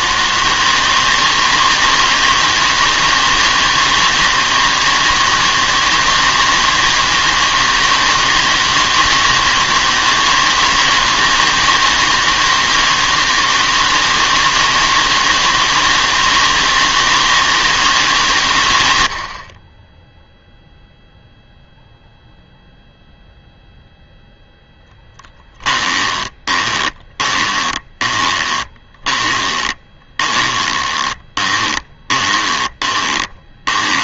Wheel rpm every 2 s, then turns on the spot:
160, 160, 160, 160, 160, 160, 160, 160, 160, 100, 0, 0, 10, 20, 20, 20, 20.
24-34